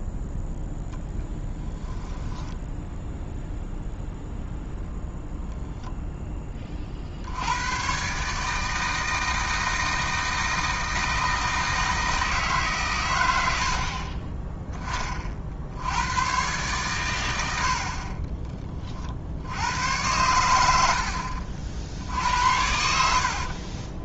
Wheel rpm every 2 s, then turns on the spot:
0, 10, 0, 40, 160, 160, 130, 10, 120, 30, 80, 70.
2-4 22-24